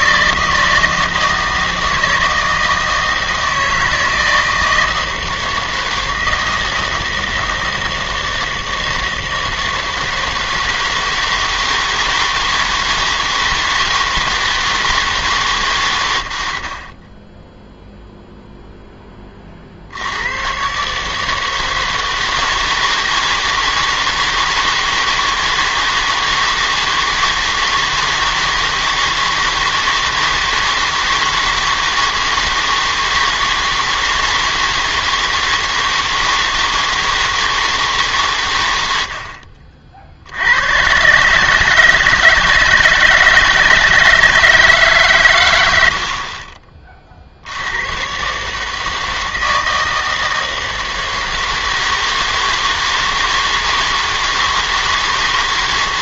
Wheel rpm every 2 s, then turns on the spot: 160, 160, 160, 160, 160, 160, 160, 160, 80, 0, 120, 160, 160, 160, 160, 160, 160, 160, 160, 110, 100, 160, 160, 30, 140, 160, 160, 160.
none